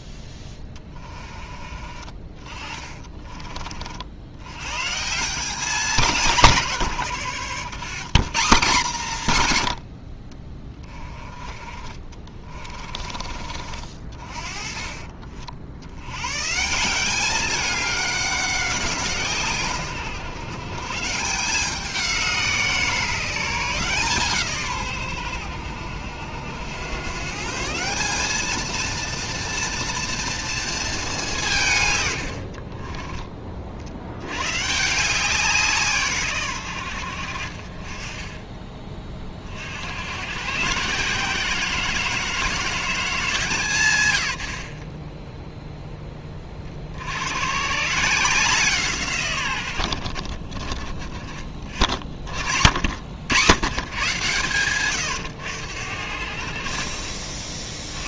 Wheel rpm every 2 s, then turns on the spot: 20, 30, 130, 140, 150, 20, 40, 30, 160, 180, 140, 170, 140, 100, 220, 220, 40, 130, 90, 20, 140, 170, 40, 50, 160, 30, 70, 110, 60.
12-14 32-34